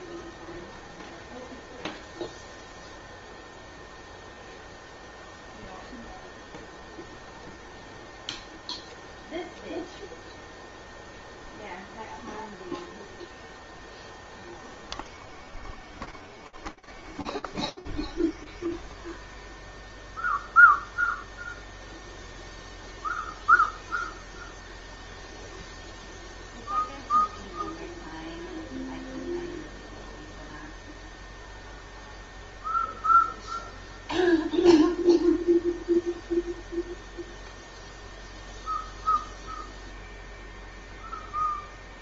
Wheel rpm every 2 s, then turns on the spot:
0, 0, 0, 0, 0, 0, 0, 0, 0, 0, 0, 0, 0, 0, 0, 0, 0, 0, 0, 0, 0.
none